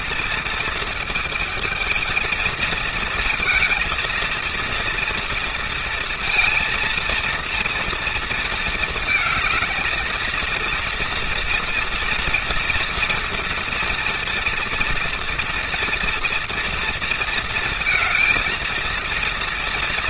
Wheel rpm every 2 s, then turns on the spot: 230, 230, 230, 230, 230, 230, 230, 230, 230, 220.
none